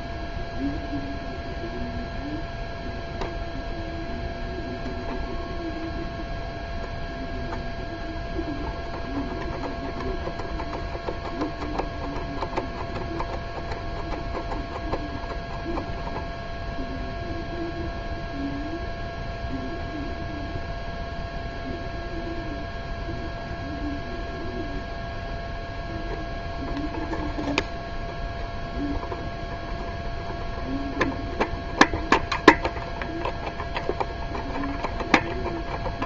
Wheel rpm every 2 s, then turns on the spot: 0, 0, 0, 0, 0, 0, 0, 0, 0, 0, 0, 0, 0, 0, 0, 0, 0, 0.
none